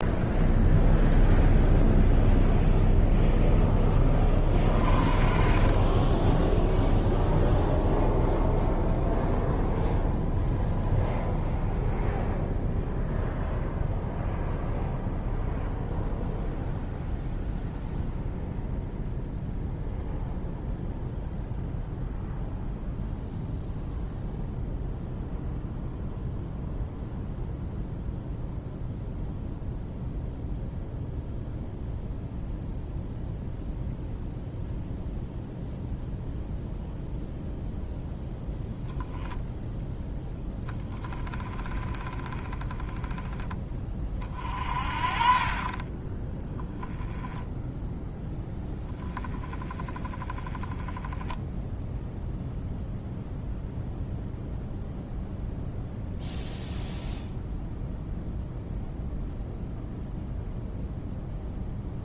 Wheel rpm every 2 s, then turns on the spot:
0, 0, 40, 0, 0, 0, 0, 0, 0, 0, 0, 0, 0, 0, 0, 0, 0, 0, 0, 0, 20, 20, 40, 10, 10, 10, 0, 0, 0, 0, 0.
none